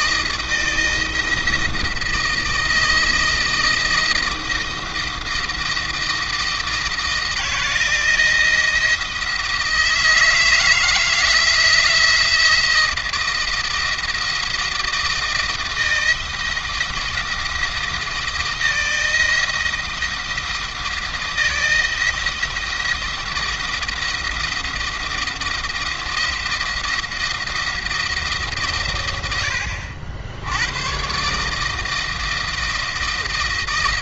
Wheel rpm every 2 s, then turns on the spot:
170, 160, 160, 160, 170, 170, 170, 170, 170, 170, 160, 170, 170, 170, 130, 110, 160.
none